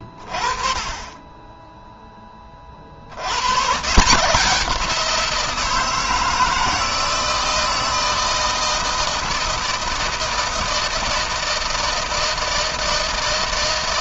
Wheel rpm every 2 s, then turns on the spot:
20, 50, 180, 160, 160, 160, 160.
none